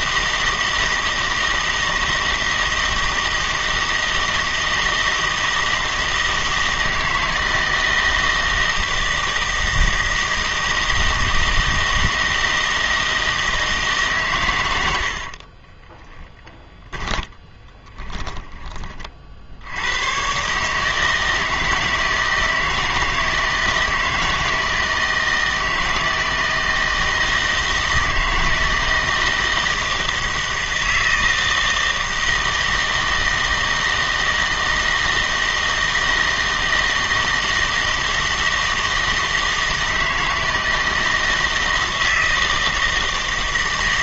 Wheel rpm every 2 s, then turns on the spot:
160, 160, 160, 160, 160, 160, 160, 100, 10, 30, 140, 160, 160, 160, 160, 160, 160, 160, 160, 160, 160, 160.
16-18